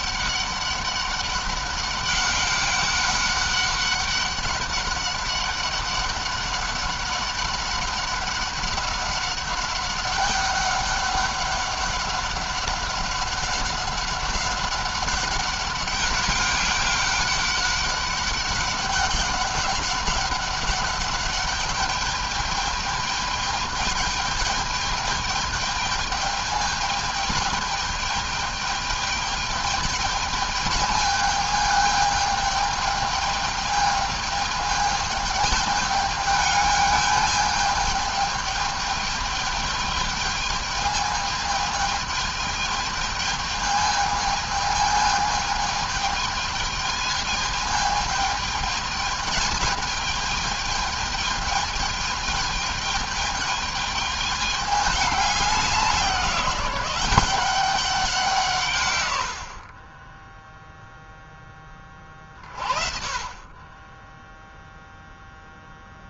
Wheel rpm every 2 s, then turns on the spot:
200, 200, 200, 200, 200, 200, 200, 200, 200, 200, 200, 210, 210, 210, 210, 210, 210, 210, 210, 210, 210, 210, 210, 220, 220, 220, 210, 210, 180, 160, 10, 30, 0.
none